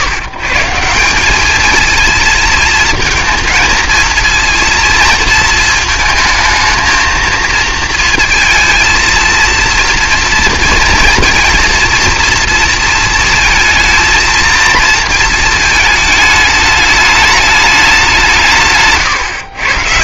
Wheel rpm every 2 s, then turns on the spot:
150, 230, 230, 230, 230, 230, 230, 230, 210, 160.
none